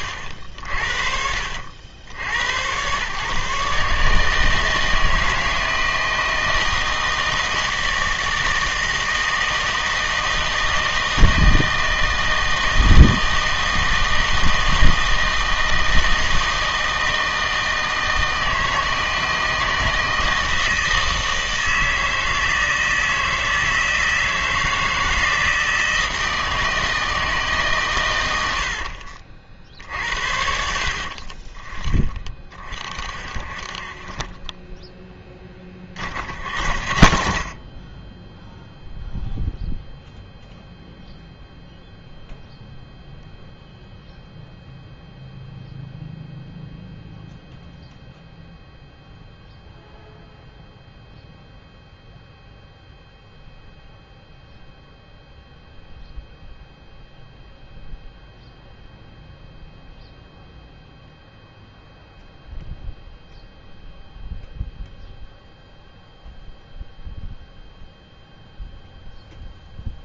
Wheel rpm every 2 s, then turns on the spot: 50, 110, 160, 160, 160, 160, 160, 160, 160, 160, 160, 160, 160, 160, 80, 60, 30, 10, 80, 0, 0, 0, 0, 0, 0, 0, 0, 0, 0, 0, 0, 0, 0, 0, 0.
28-30